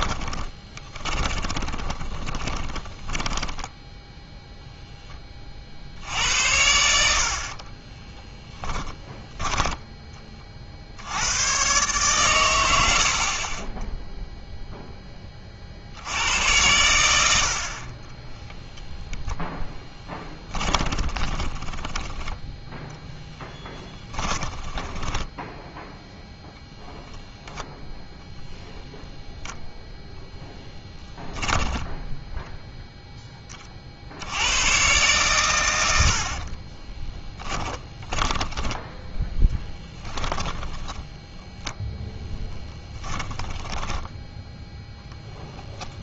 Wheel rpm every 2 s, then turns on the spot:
20, 20, 0, 70, 10, 50, 90, 0, 100, 0, 10, 0, 20, 0, 0, 10, 0, 120, 30, 10, 10, 10, 0.
0-4 8-10 20-22 24-26 30-32 36-38 40-44